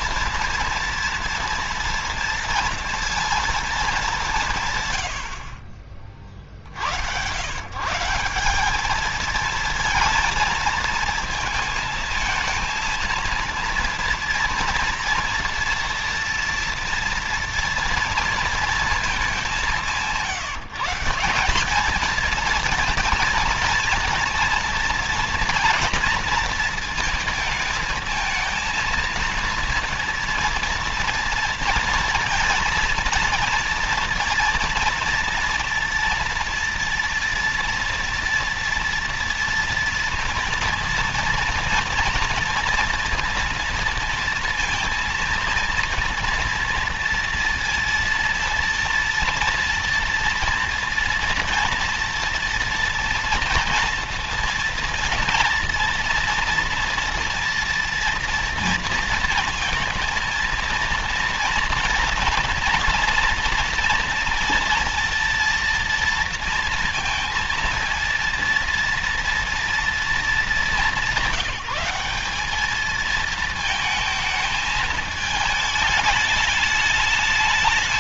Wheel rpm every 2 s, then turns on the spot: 230, 230, 120, 100, 210, 230, 230, 230, 230, 220, 170, 230, 230, 220, 230, 230, 230, 230, 240, 230, 230, 230, 230, 230, 230, 230, 230, 230, 230, 230, 230, 230, 230, 230, 230, 210, 210, 220, 210.
none